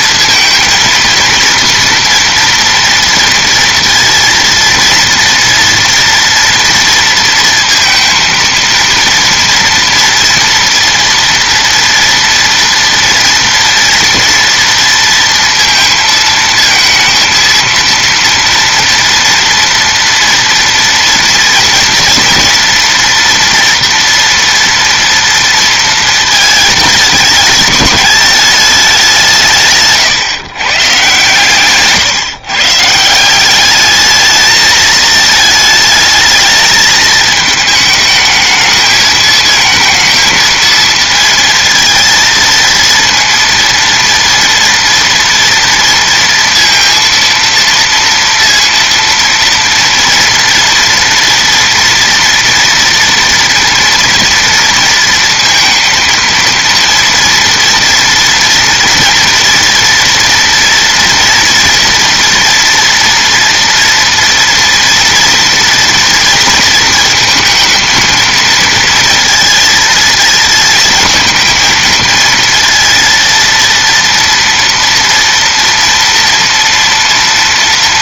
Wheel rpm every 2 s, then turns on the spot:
230, 230, 230, 230, 230, 240, 230, 230, 230, 230, 230, 230, 230, 220, 220, 130, 140, 220, 220, 220, 230, 230, 230, 230, 230, 230, 230, 230, 230, 230, 230, 230, 230, 230, 230, 230, 230, 230, 230.
none